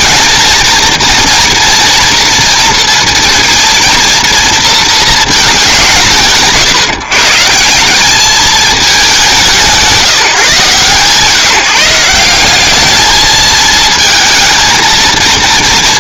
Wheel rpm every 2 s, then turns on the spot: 230, 230, 230, 130, 220, 160, 200, 220.
none